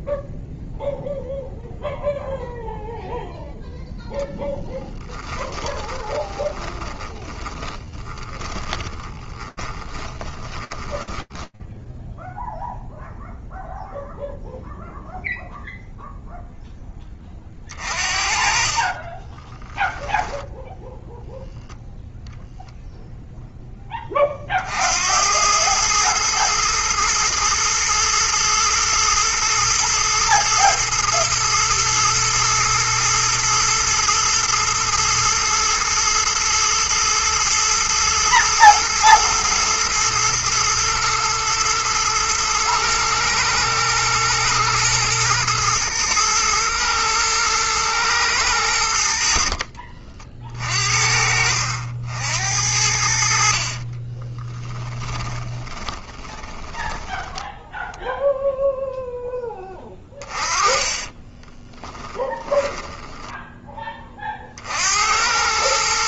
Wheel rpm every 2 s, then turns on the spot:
0, 0, 20, 20, 20, 10, 0, 0, 20, 20, 0, 0, 90, 110, 110, 120, 120, 110, 110, 110, 110, 120, 110, 110, 60, 60, 70, 20, 10, 0, 20, 10, 80.
4-12 18-20 48-50 54-58 60-64